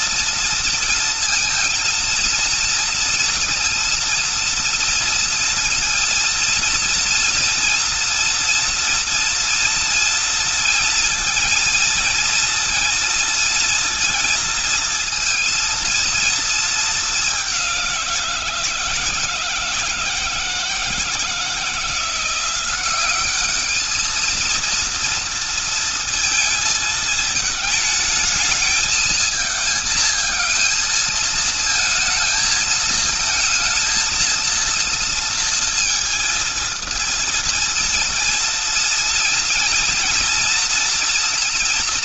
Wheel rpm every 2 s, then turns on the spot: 230, 230, 230, 230, 230, 230, 230, 230, 220, 170, 160, 180, 230, 220, 220, 220, 220, 230, 230, 230, 240.
none